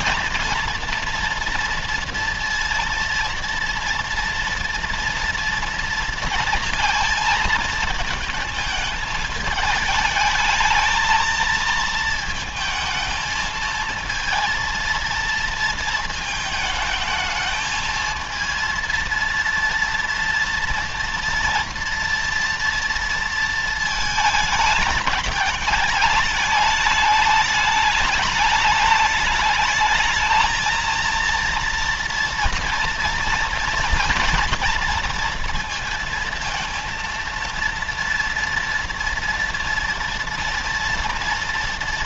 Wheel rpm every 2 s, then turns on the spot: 240, 230, 230, 230, 220, 220, 220, 230, 220, 230, 230, 230, 220, 210, 210, 220, 230, 230, 230, 230, 230.
none